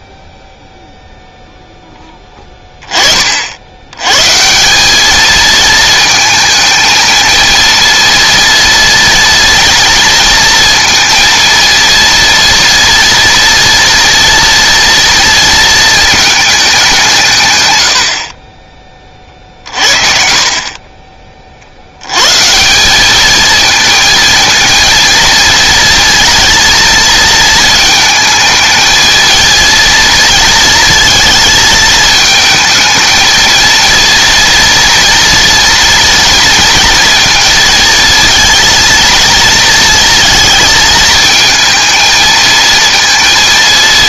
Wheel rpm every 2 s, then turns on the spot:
0, 20, 180, 230, 230, 230, 230, 230, 210, 30, 40, 160, 230, 230, 220, 220, 220, 240, 230, 230, 220, 230.
20-22